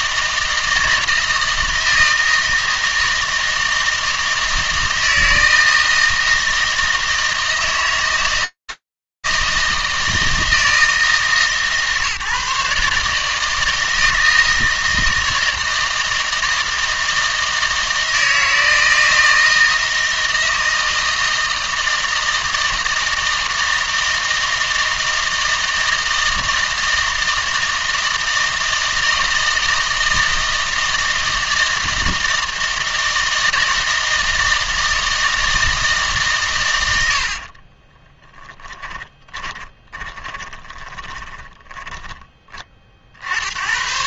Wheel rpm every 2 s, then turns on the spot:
160, 160, 160, 160, 160, 150, 150, 160, 160, 160, 160, 160, 160, 160, 160, 160, 160, 160, 120, 10, 30, 40.
38-42